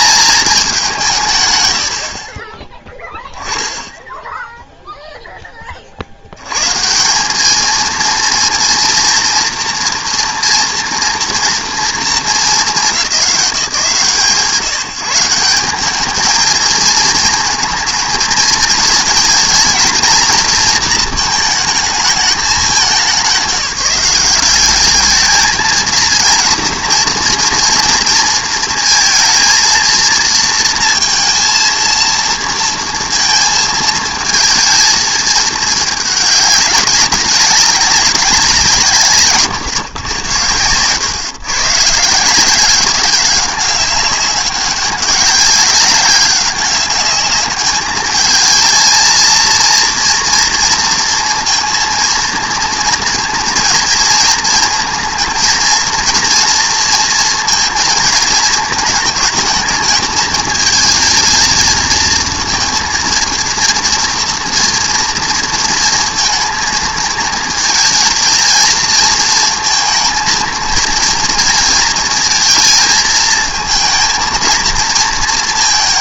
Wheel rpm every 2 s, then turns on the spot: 200, 20, 0, 140, 230, 230, 200, 160, 220, 220, 230, 200, 210, 230, 230, 230, 230, 230, 200, 180, 110, 180, 200, 200, 220, 230, 230, 230, 240, 220, 220, 230, 230, 220, 230, 230, 220, 230.
none